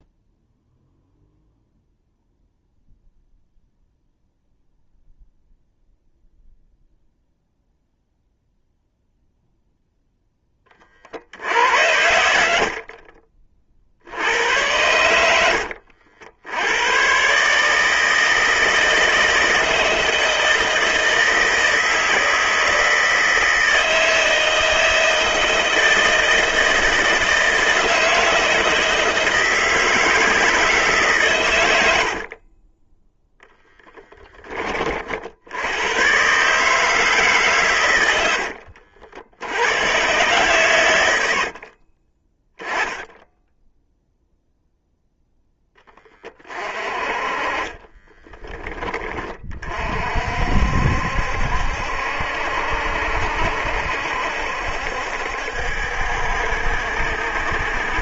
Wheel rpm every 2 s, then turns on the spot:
0, 0, 0, 0, 0, 40, 50, 90, 110, 160, 160, 160, 160, 160, 160, 140, 10, 40, 150, 70, 100, 10, 0, 30, 20, 70, 70, 70, 70.
12-14 32-34